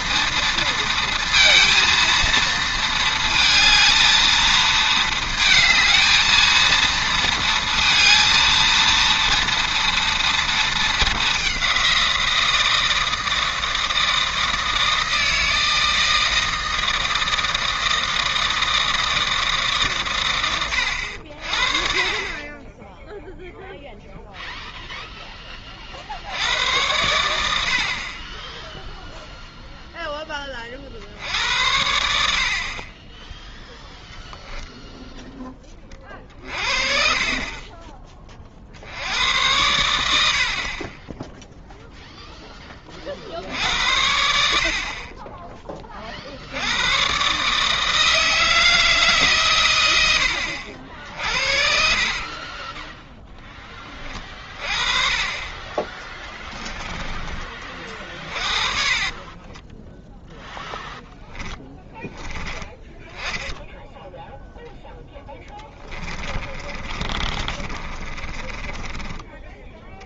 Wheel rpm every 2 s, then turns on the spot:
230, 230, 220, 220, 230, 230, 170, 160, 160, 160, 90, 20, 0, 90, 10, 30, 50, 10, 40, 60, 60, 10, 60, 90, 160, 60, 30, 30, 10, 30, 0, 10, 0, 30, 20.
52-54 56-60 66-70